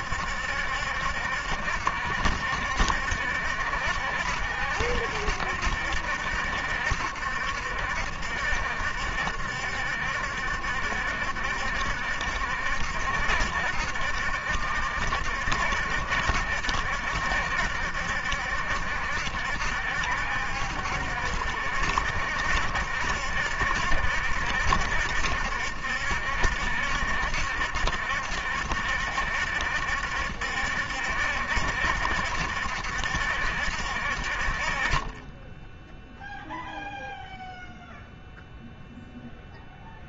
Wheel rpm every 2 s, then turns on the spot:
70, 70, 70, 70, 70, 70, 70, 70, 70, 70, 70, 70, 60, 70, 70, 70, 70, 30, 0, 0.
none